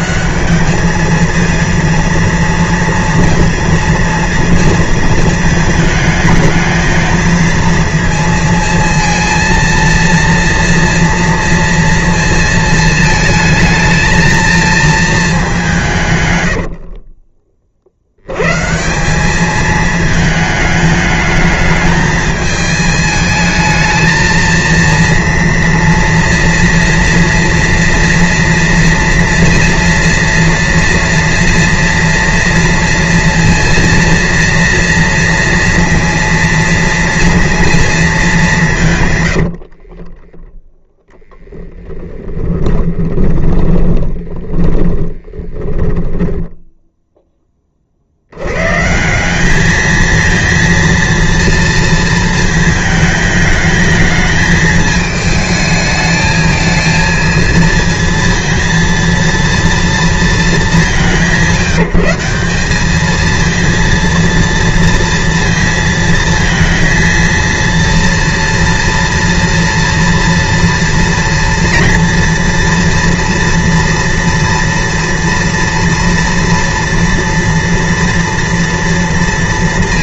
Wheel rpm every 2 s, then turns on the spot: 220, 230, 230, 220, 230, 230, 220, 230, 70, 170, 210, 220, 230, 230, 230, 230, 230, 230, 230, 170, 0, 20, 10, 0, 140, 230, 220, 220, 220, 230, 180, 210, 230, 230, 230, 230, 230, 230, 230, 230.
16-18 42-46